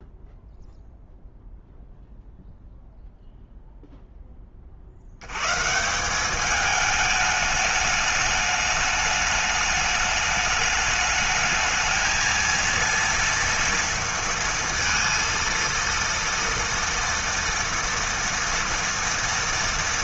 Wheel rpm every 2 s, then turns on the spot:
0, 0, 70, 210, 210, 220, 230, 230, 230, 230.
none